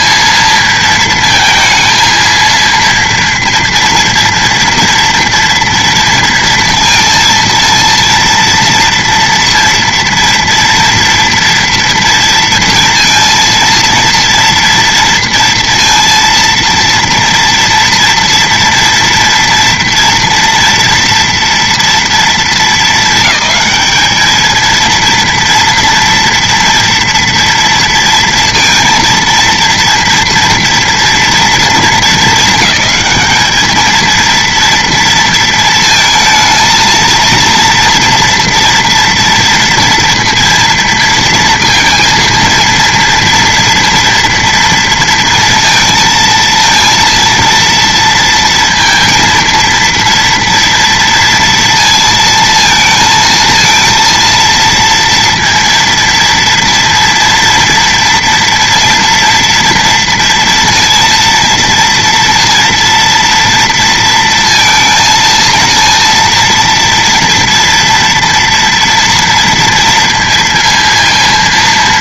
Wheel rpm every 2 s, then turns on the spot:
230, 230, 230, 230, 230, 230, 230, 230, 230, 230, 230, 220, 220, 230, 230, 230, 210, 230, 230, 240, 230, 230, 230, 230, 230, 230, 230, 230, 230, 230, 230, 230, 230, 230, 240, 230.
none